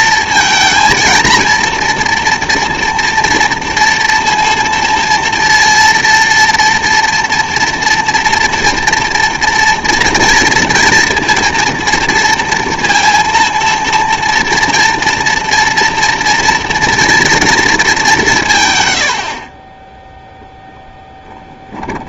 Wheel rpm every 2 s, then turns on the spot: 230, 240, 230, 230, 230, 230, 220, 230, 230, 110, 10.
none